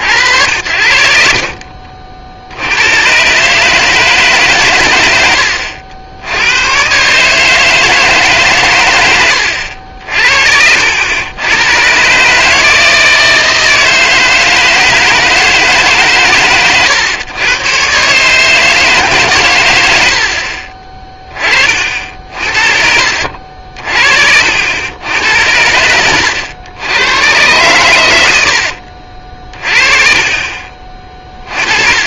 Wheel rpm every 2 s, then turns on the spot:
60, 90, 110, 110, 120, 70, 160, 160, 110, 150, 40, 50, 80, 90, 70, 40.
28-30